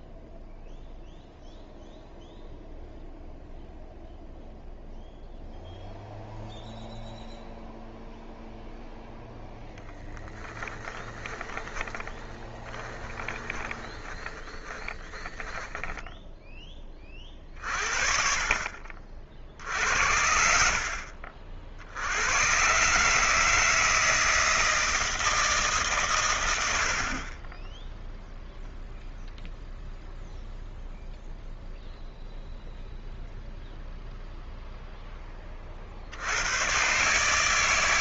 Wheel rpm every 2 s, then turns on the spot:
0, 0, 0, 0, 0, 10, 30, 20, 10, 40, 60, 130, 160, 90, 0, 0, 0, 0, 130.
10-16